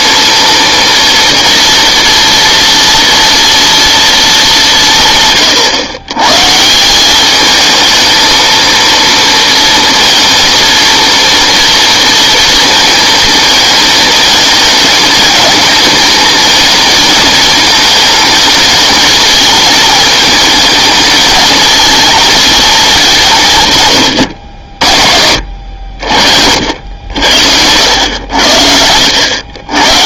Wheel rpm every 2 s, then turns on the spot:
240, 240, 190, 160, 230, 230, 230, 210, 220, 220, 220, 220, 70, 70, 70.
none